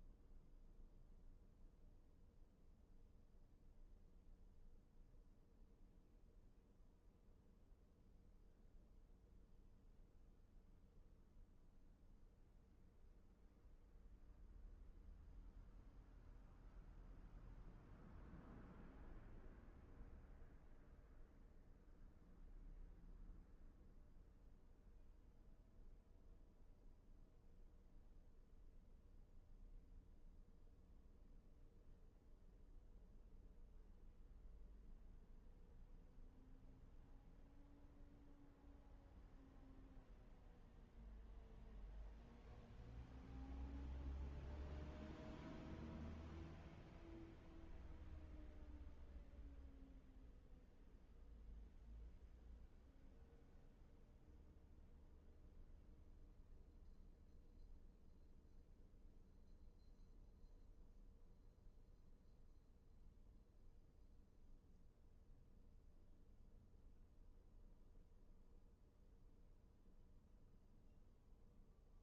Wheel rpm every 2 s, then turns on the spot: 0, 0, 0, 0, 0, 0, 0, 0, 0, 0, 0, 0, 0, 0, 0, 0, 0, 0, 0, 0, 0, 0, 0, 0, 0, 0, 0, 0, 0, 0, 0, 0, 0, 0, 0, 0.
none